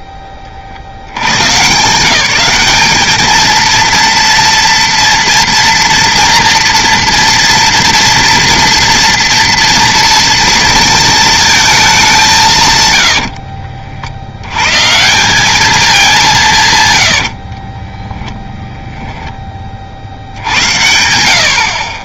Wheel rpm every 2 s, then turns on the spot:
70, 200, 240, 230, 230, 230, 140, 120, 170, 10, 90.
18-20